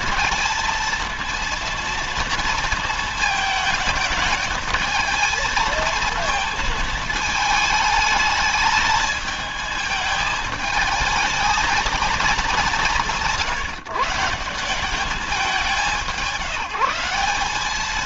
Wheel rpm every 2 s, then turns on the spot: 230, 230, 220, 220, 220, 220, 190, 190, 170.
none